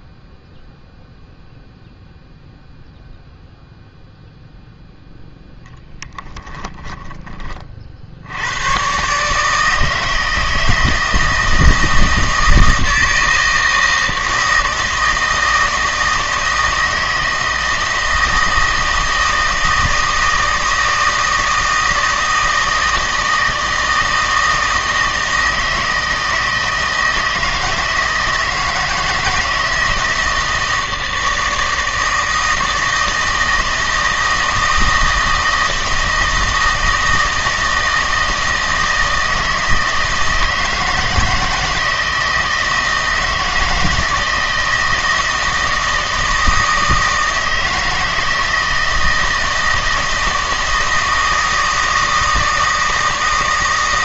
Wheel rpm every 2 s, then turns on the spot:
0, 0, 0, 10, 120, 160, 160, 160, 160, 160, 160, 160, 160, 160, 170, 160, 160, 160, 160, 160, 160, 160, 160, 160, 160, 160, 160.
6-8